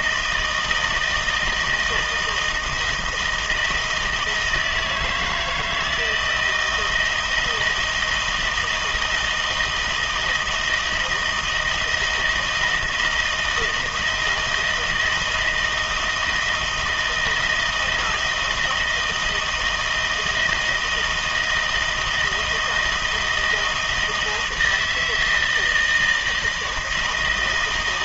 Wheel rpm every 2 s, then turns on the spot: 160, 160, 160, 160, 170, 160, 160, 160, 160, 160, 160, 160, 160, 160.
none